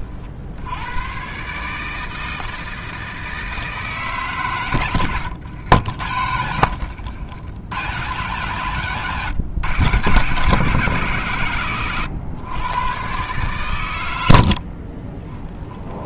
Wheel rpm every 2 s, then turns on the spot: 120, 160, 100, 100, 130, 130, 130, 20.
14-16